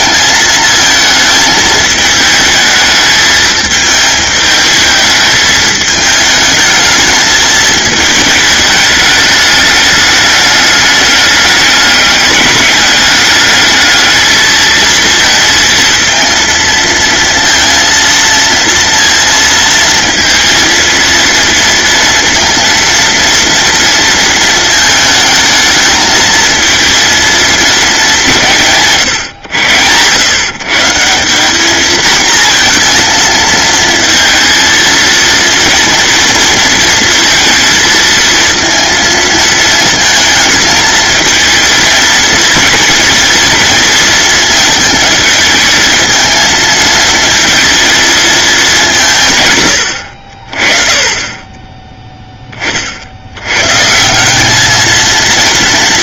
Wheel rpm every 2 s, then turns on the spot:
220, 220, 220, 220, 210, 210, 210, 220, 230, 230, 230, 230, 220, 230, 150, 150, 230, 220, 230, 230, 220, 230, 220, 220, 180, 30, 40, 220.
none